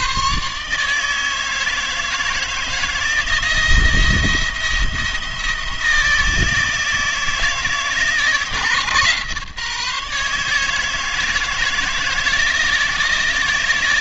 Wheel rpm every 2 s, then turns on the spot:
130, 160, 170, 160, 160, 160, 160.
none